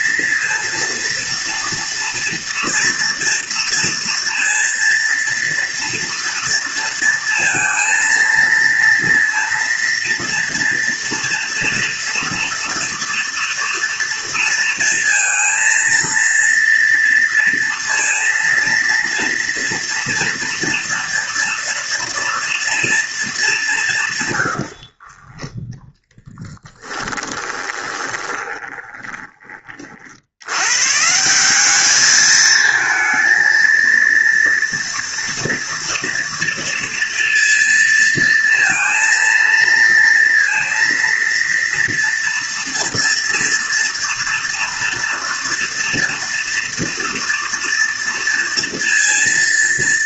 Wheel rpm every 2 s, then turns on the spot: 230, 230, 230, 230, 230, 230, 230, 230, 230, 230, 230, 230, 70, 10, 20, 120, 230, 240, 230, 230, 230, 230, 230, 240, 230.
24-30